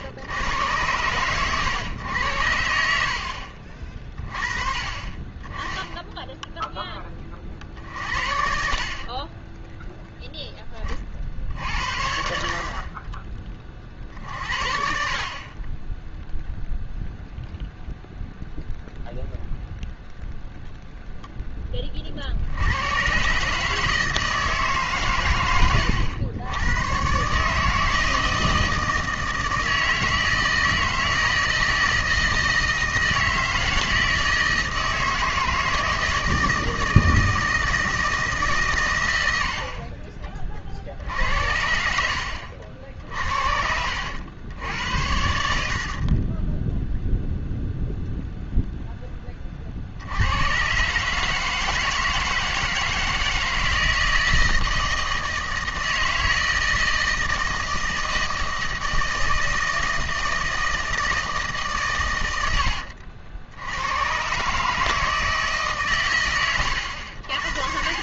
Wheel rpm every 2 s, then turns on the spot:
100, 80, 30, 10, 50, 10, 50, 50, 0, 0, 0, 80, 150, 100, 160, 160, 160, 160, 160, 130, 50, 70, 90, 10, 0, 120, 160, 160, 160, 160, 160, 80, 140, 100.
46-48